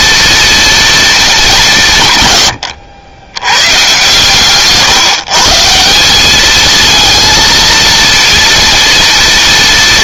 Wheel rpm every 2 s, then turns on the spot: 230, 110, 140, 220, 230.
none